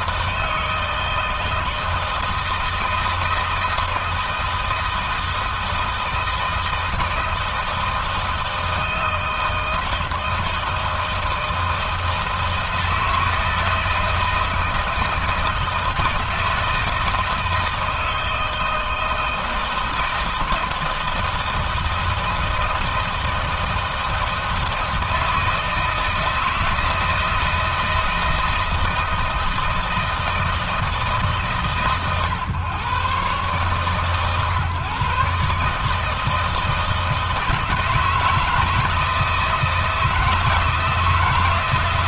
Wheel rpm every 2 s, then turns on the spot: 160, 160, 160, 160, 160, 160, 160, 160, 160, 160, 160, 160, 160, 160, 160, 150, 120, 140, 160, 160, 160.
none